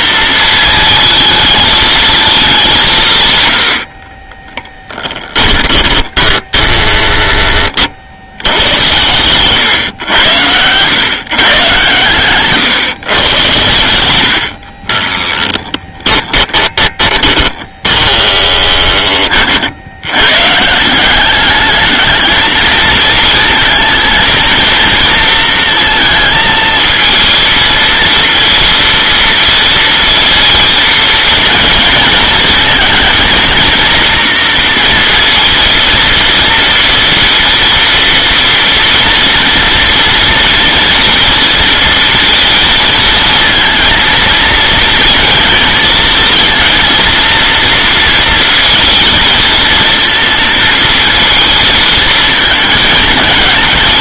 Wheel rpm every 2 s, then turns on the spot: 220, 200, 10, 10, 100, 110, 140, 50, 20, 20, 140, 220, 230, 220, 230, 220, 230, 230, 230, 230, 230, 230, 230, 230, 230, 230, 220.
4-8 14-20